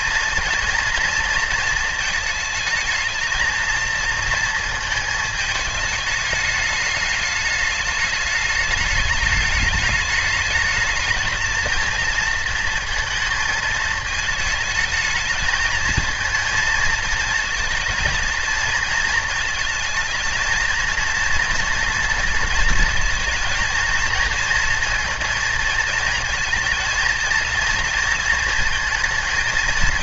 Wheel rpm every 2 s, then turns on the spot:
230, 220, 220, 210, 210, 220, 230, 220, 230, 230, 230, 220, 230, 230, 230.
none